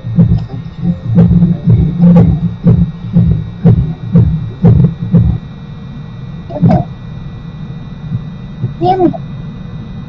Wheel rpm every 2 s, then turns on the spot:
0, 0, 0, 0, 0.
none